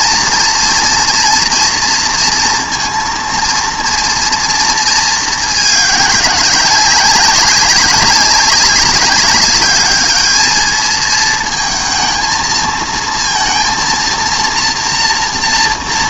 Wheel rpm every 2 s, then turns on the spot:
240, 230, 220, 190, 200, 220, 220, 230.
none